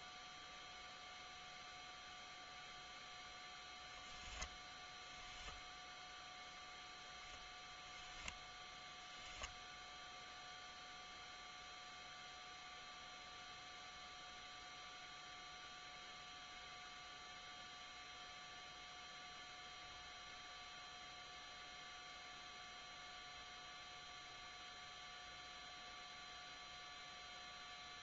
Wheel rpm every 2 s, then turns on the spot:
0, 0, 0, 0, 0, 0, 0, 0, 0, 0, 0, 0, 0, 0.
none